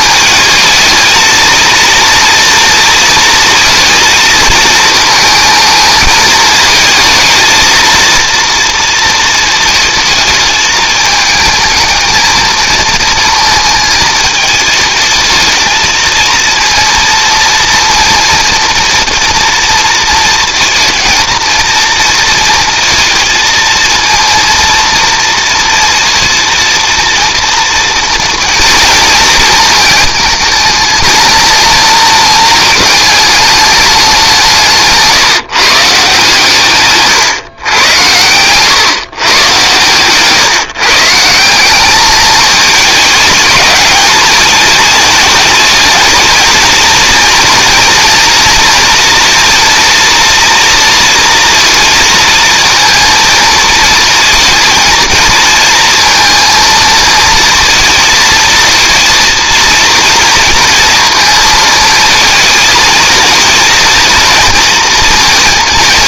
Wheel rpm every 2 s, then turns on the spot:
220, 230, 220, 220, 230, 220, 220, 220, 230, 230, 230, 230, 230, 230, 230, 220, 220, 160, 150, 130, 140, 220, 210, 230, 230, 230, 230, 220, 230, 230, 230, 220, 230.
34-36